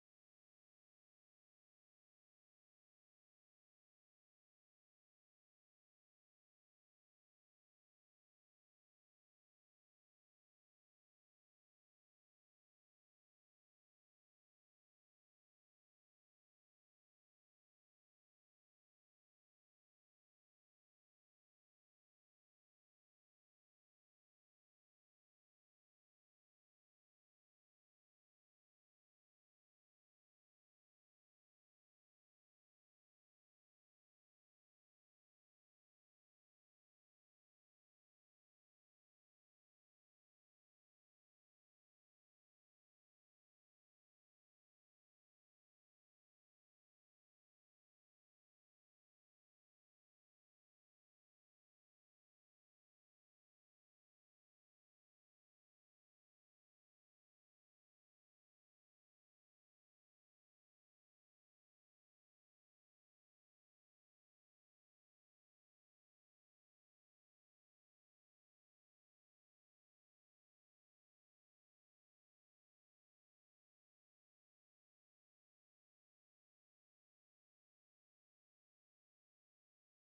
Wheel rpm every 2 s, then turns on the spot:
0, 0, 0, 0, 0, 0, 0, 0, 0, 0, 0, 0, 0, 0, 0, 0, 0, 0, 0, 0, 0, 0, 0, 0, 0, 0, 0, 0, 0, 0, 0, 0, 0, 0, 0, 0, 0, 0, 0, 0.
none